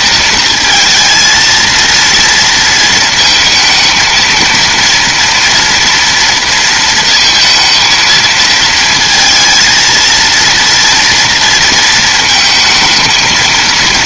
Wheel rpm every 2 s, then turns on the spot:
230, 230, 230, 230, 220, 230, 220.
none